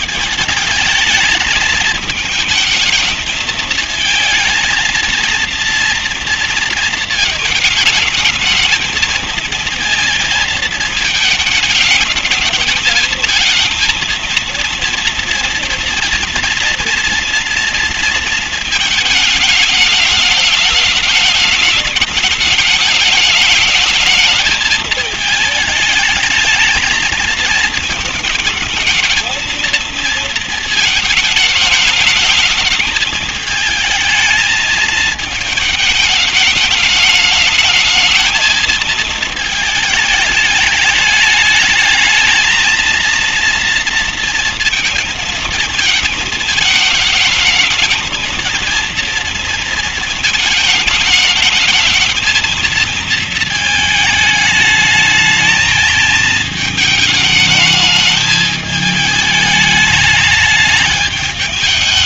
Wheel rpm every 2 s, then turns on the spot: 210, 220, 220, 230, 220, 220, 220, 230, 230, 220, 210, 210, 220, 220, 220, 230, 220, 220, 210, 220, 210, 220, 230, 220, 230, 220, 220, 210, 220, 220, 210.
none